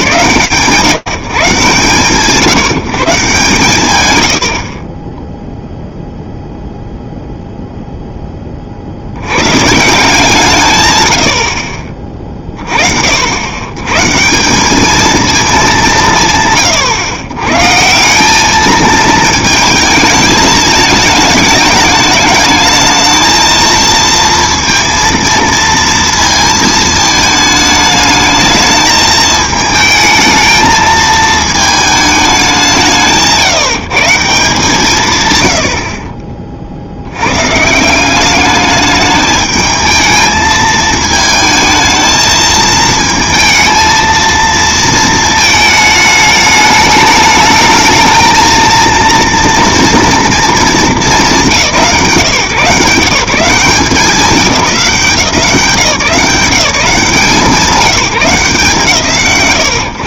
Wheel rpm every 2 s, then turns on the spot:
150, 150, 0, 0, 90, 90, 70, 220, 110, 220, 220, 220, 230, 220, 220, 220, 160, 130, 90, 210, 220, 220, 220, 210, 230, 190, 170, 190, 190, 160.
none